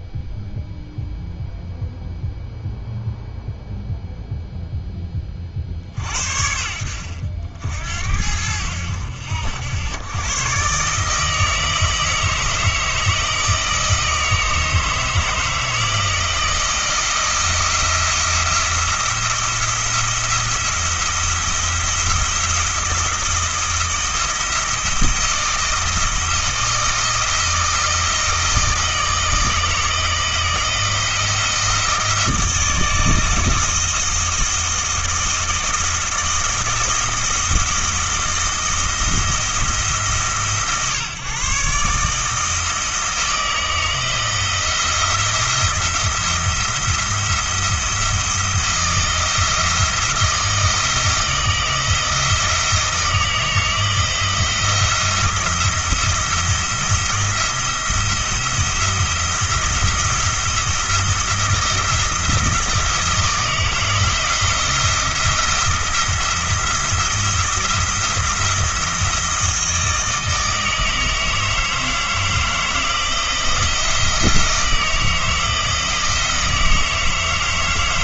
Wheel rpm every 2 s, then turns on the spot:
0, 0, 10, 70, 80, 140, 160, 160, 160, 170, 170, 170, 170, 160, 160, 160, 160, 160, 170, 160, 140, 160, 170, 170, 170, 160, 160, 170, 170, 170, 160, 170, 170, 170, 160, 160, 160, 160, 160.
none